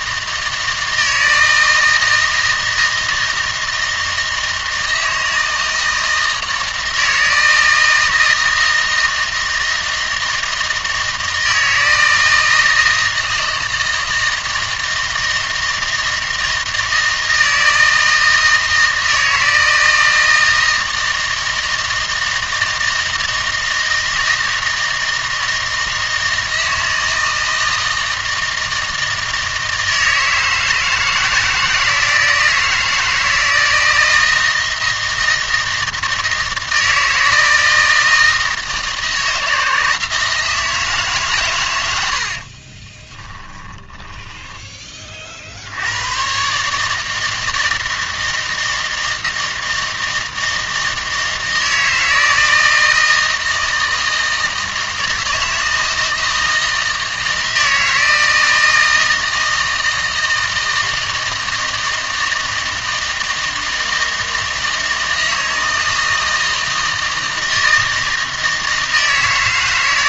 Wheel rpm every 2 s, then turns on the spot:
160, 160, 160, 160, 160, 160, 160, 160, 160, 160, 160, 160, 160, 160, 160, 160, 160, 160, 160, 160, 160, 40, 20, 140, 160, 160, 160, 160, 160, 160, 160, 160, 160, 160, 160.
42-44